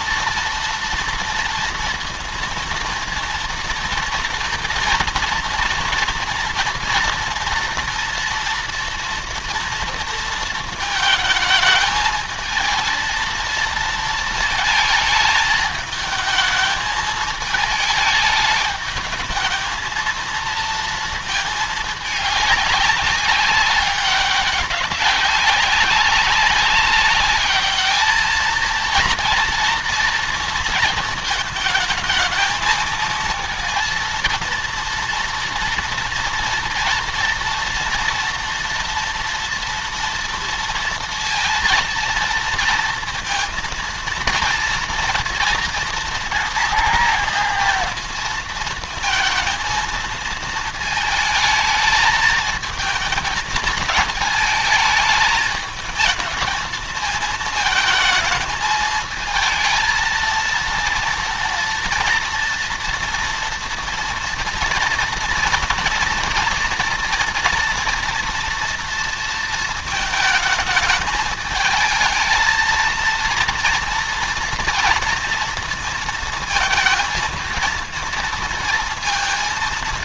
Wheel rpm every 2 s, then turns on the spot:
230, 230, 230, 230, 230, 220, 220, 220, 220, 210, 230, 200, 190, 200, 220, 230, 220, 230, 230, 240, 230, 230, 230, 230, 230, 230, 220, 220, 220, 220, 230, 230, 230, 230, 230, 220, 220, 230, 230, 230.
none